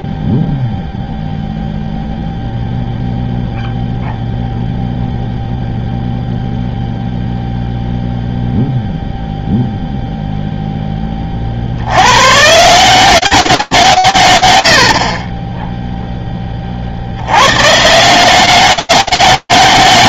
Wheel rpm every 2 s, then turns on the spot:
0, 0, 0, 0, 0, 10, 170, 40, 60, 200.
none